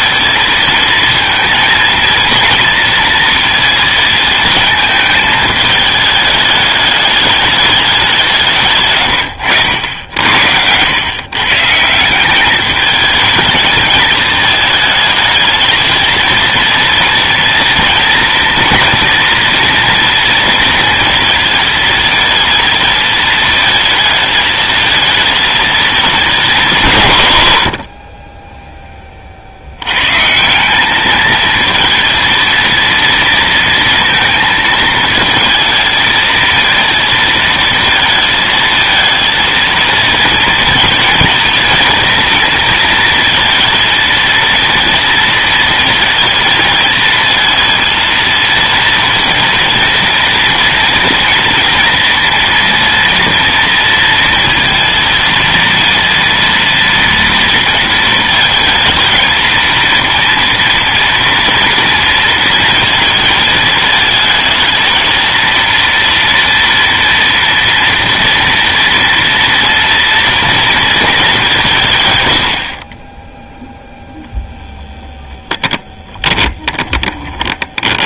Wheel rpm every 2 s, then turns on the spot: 220, 230, 220, 210, 130, 90, 210, 220, 230, 230, 230, 220, 220, 180, 10, 190, 230, 220, 230, 220, 230, 230, 230, 230, 230, 230, 230, 230, 230, 220, 230, 230, 220, 230, 230, 230, 40, 0, 20.
8-10 76-78